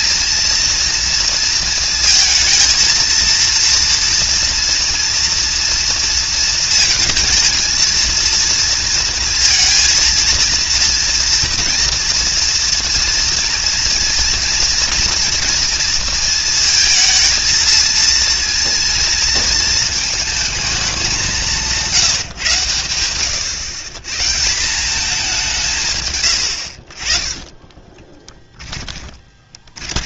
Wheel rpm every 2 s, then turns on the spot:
230, 230, 230, 220, 230, 230, 230, 230, 230, 230, 200, 110, 200, 50, 20.
26-30